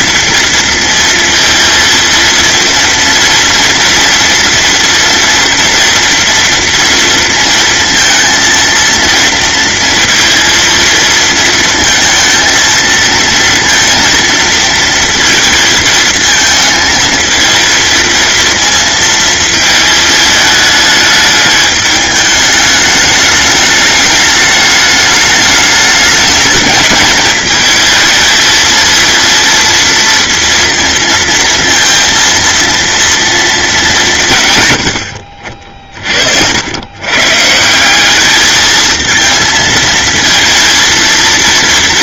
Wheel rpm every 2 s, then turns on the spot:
230, 230, 230, 230, 230, 230, 230, 230, 220, 230, 210, 210, 210, 220, 230, 230, 230, 100, 110, 220, 230.
none